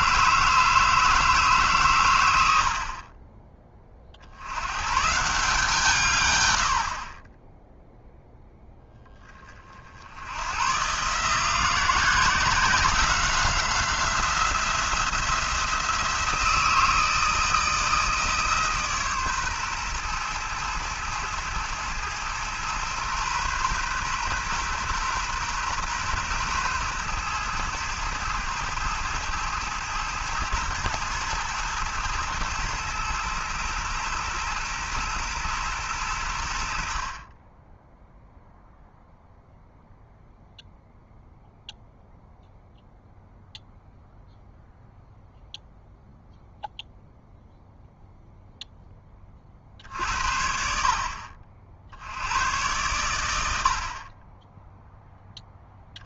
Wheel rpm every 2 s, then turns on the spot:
160, 70, 120, 80, 10, 120, 180, 170, 160, 150, 110, 120, 120, 120, 110, 110, 110, 120, 60, 0, 0, 0, 0, 0, 10, 50, 110, 0.
none